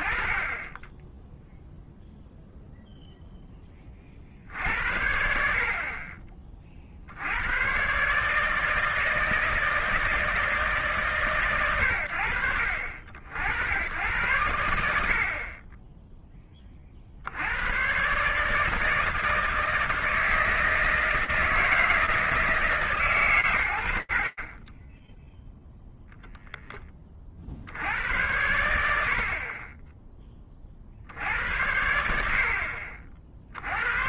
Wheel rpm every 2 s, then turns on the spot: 20, 10, 60, 90, 160, 100, 80, 30, 110, 160, 160, 70, 0, 70, 30, 70, 100.
none